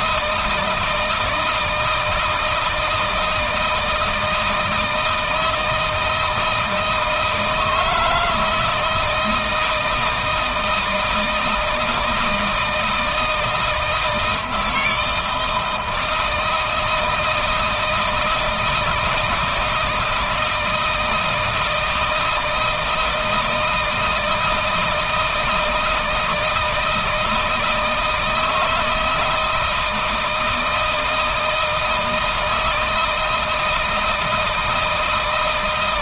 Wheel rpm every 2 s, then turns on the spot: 160, 160, 160, 160, 160, 170, 160, 160, 160, 160, 160, 160, 160, 160, 160, 160, 160, 160.
none